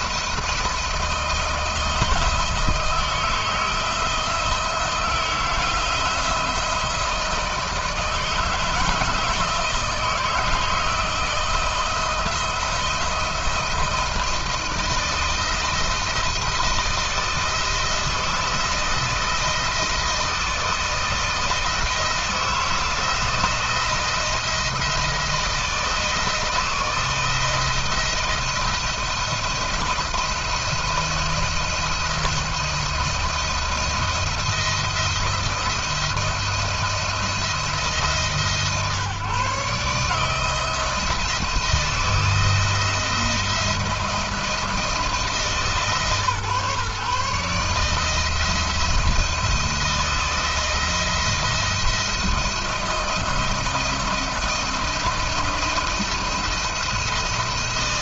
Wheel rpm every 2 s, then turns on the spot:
160, 160, 160, 170, 160, 160, 160, 170, 170, 160, 160, 170, 170, 160, 170, 170, 170, 170, 170, 140, 160, 170, 160, 150, 170, 160, 170, 170, 160.
none